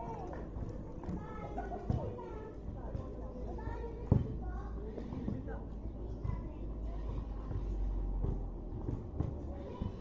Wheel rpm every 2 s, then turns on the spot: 0, 0, 0, 0, 0.
none